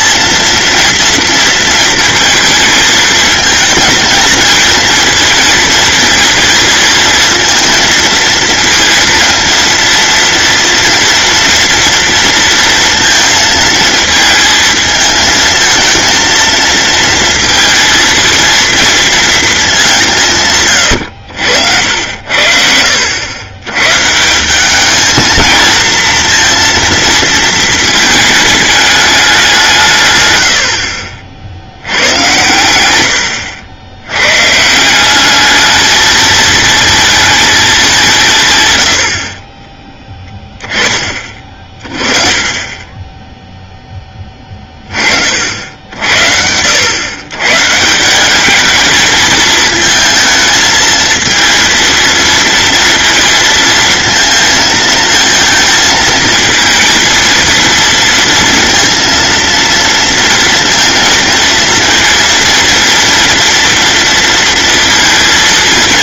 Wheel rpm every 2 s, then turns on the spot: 230, 230, 230, 230, 230, 240, 230, 220, 230, 230, 110, 70, 210, 230, 210, 70, 100, 170, 220, 110, 20, 20, 30, 100, 210, 220, 230, 220, 230, 230, 230, 230, 230.
20-22 42-44